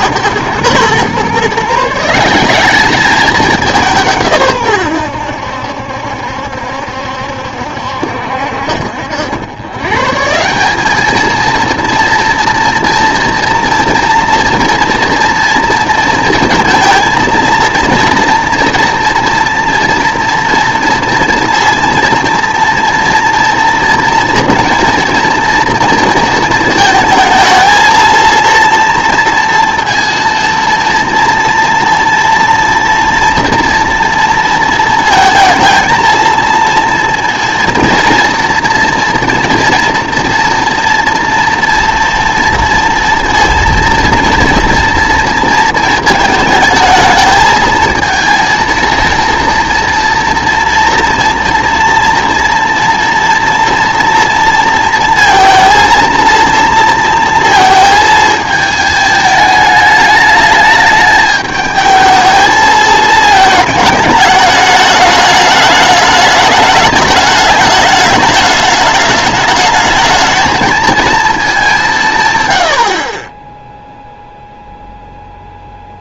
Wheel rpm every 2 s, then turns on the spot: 120, 190, 120, 70, 60, 180, 230, 230, 230, 230, 230, 230, 230, 220, 230, 230, 230, 230, 230, 240, 230, 230, 240, 220, 230, 230, 230, 230, 230, 220, 210, 220, 210, 220, 210, 220, 100, 0.
none